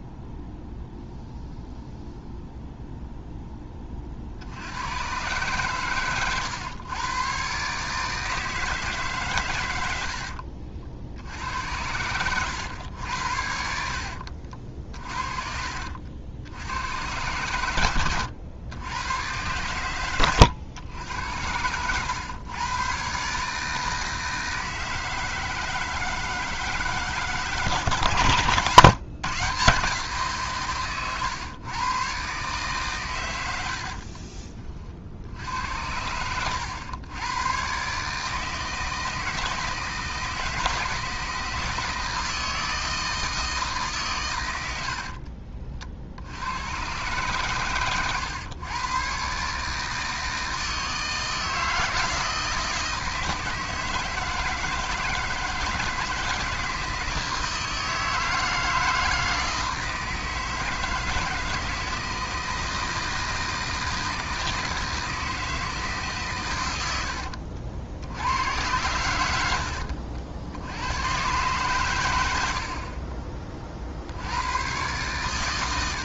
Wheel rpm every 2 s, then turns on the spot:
0, 0, 80, 110, 160, 60, 100, 50, 80, 90, 100, 120, 160, 160, 140, 140, 130, 40, 100, 160, 160, 160, 100, 100, 110, 160, 160, 160, 160, 160, 160, 160, 160, 110, 100, 90, 60, 100.
14-16 28-30